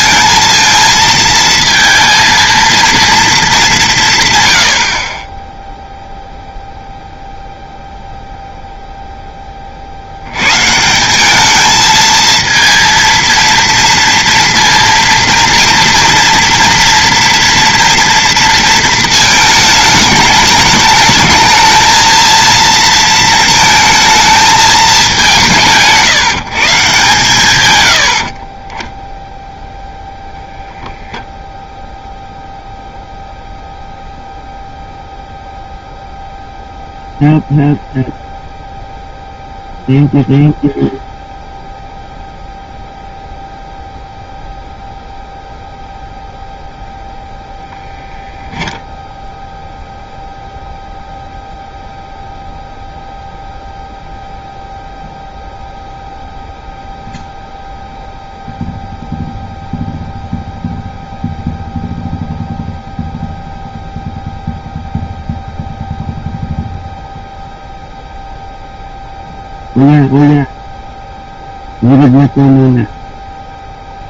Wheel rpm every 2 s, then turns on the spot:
230, 230, 110, 0, 0, 140, 230, 230, 240, 230, 210, 230, 220, 160, 40, 0, 0, 0, 0, 0, 0, 0, 0, 0, 0, 0, 0, 0, 0, 0, 0, 0, 0, 0, 0, 0, 0.
28-30